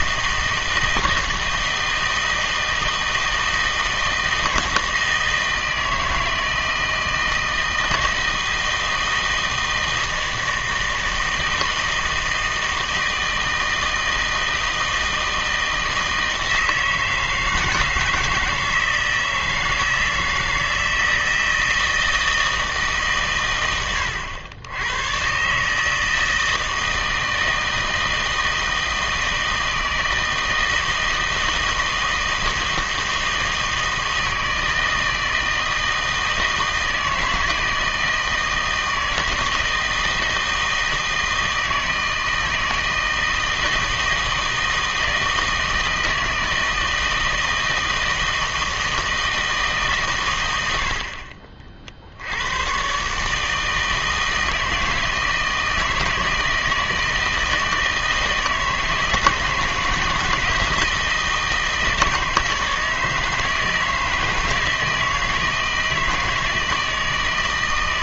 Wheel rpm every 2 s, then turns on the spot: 160, 160, 160, 160, 160, 160, 160, 160, 160, 160, 160, 160, 100, 160, 160, 160, 160, 160, 160, 160, 160, 160, 160, 160, 160, 90, 90, 160, 160, 160, 160, 160, 160, 160.
50-52